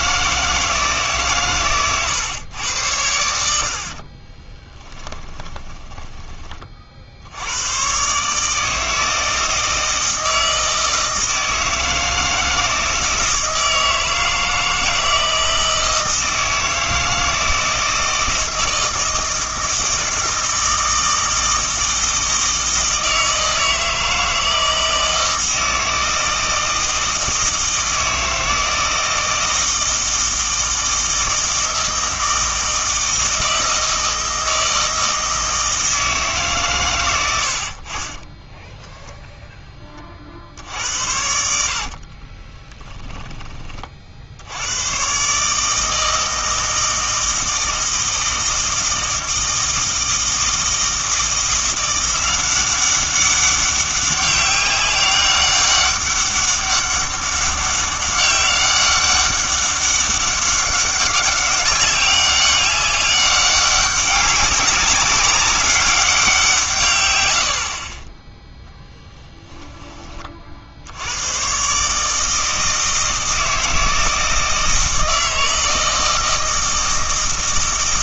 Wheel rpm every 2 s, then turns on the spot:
160, 100, 20, 30, 160, 160, 160, 160, 160, 160, 160, 160, 160, 160, 160, 160, 160, 160, 140, 10, 70, 20, 90, 160, 160, 160, 190, 200, 200, 200, 200, 200, 200, 140, 10, 60, 160, 160, 160.
4-6 38-40 42-44